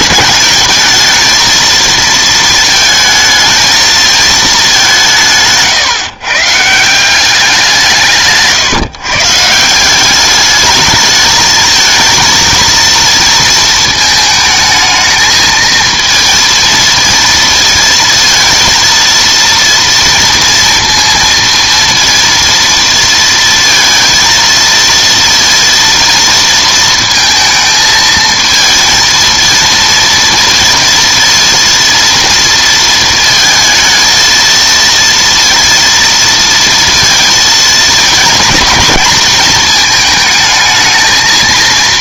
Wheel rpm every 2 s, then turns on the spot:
220, 230, 210, 150, 150, 200, 230, 220, 230, 230, 230, 230, 230, 230, 230, 230, 230, 230, 230, 230, 220.
none